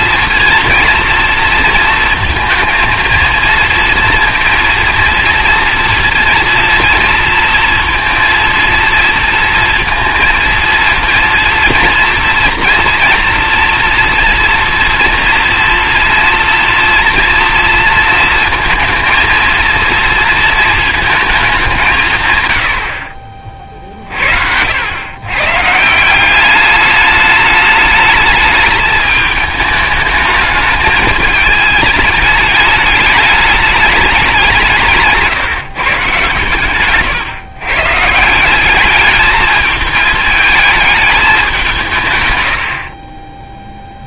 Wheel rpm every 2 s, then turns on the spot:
230, 230, 230, 230, 230, 230, 240, 230, 230, 230, 220, 40, 110, 210, 210, 210, 210, 160, 130, 210, 210, 30.
none